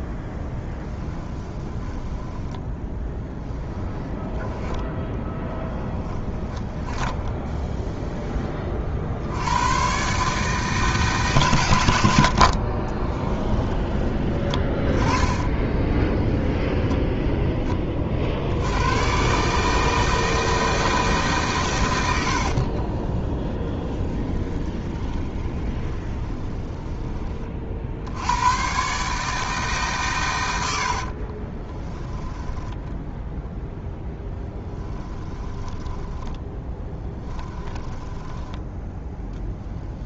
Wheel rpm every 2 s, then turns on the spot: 10, 10, 10, 10, 40, 150, 30, 20, 10, 110, 160, 50, 30, 20, 140, 70, 10, 10, 10, 10.
0-4 6-8 12-14 16-18 22-28 32-38